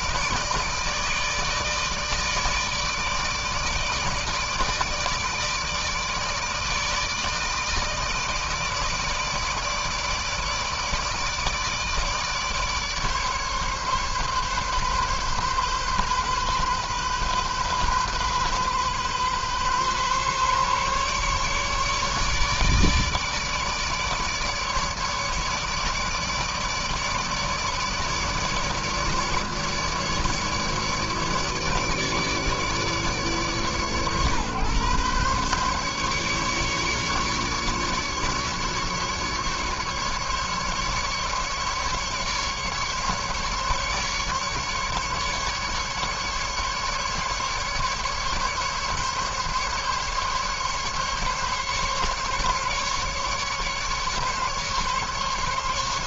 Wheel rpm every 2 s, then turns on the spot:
150, 150, 150, 150, 160, 150, 150, 140, 130, 130, 140, 150, 150, 150, 150, 150, 150, 130, 140, 150, 150, 150, 150, 150, 140, 140, 140, 140.
none